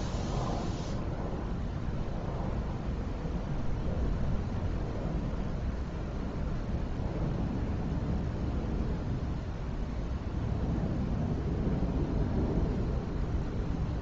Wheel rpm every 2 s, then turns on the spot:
0, 0, 0, 0, 0, 0, 0.
none